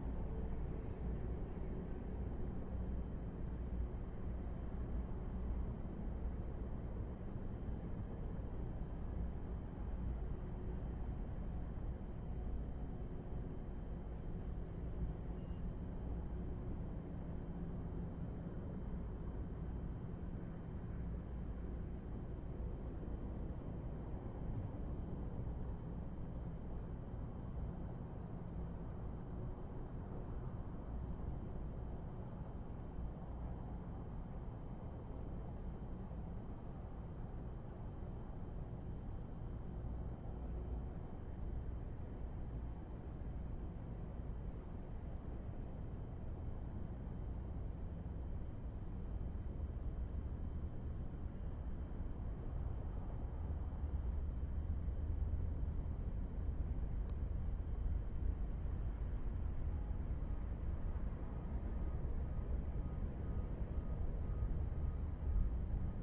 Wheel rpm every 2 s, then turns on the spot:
0, 0, 0, 0, 0, 0, 0, 0, 0, 0, 0, 0, 0, 0, 0, 0, 0, 0, 0, 0, 0, 0, 0, 0, 0, 0, 0, 0, 0, 0, 0, 0, 0.
none